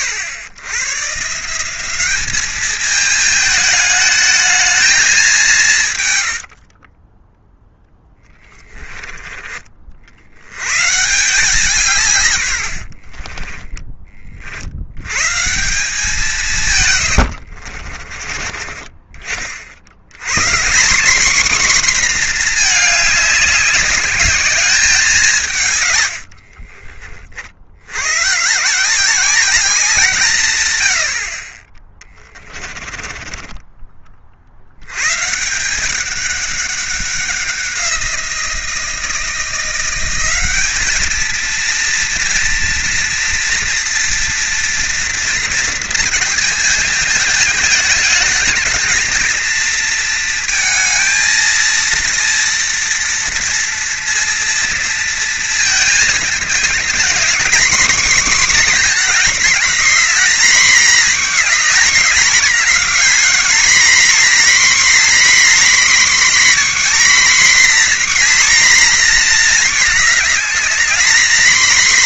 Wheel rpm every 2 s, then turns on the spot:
110, 220, 220, 40, 10, 130, 70, 80, 140, 30, 190, 220, 200, 50, 160, 110, 30, 80, 200, 170, 210, 240, 230, 220, 230, 230, 230, 230, 230, 260, 240, 250, 270, 280, 240, 230.
6-8 12-14 16-18 26-28 32-34